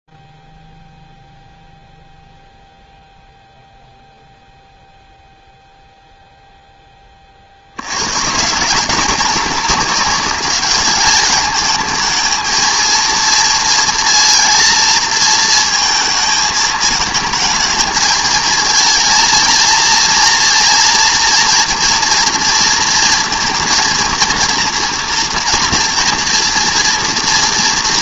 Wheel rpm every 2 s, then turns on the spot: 0, 0, 0, 10, 160, 200, 220, 230, 220, 220, 230, 240, 230, 230.
none